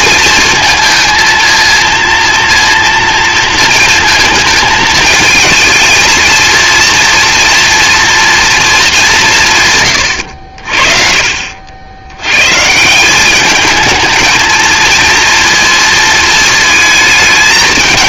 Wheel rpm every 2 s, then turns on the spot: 230, 230, 220, 230, 220, 60, 160, 230, 220.
none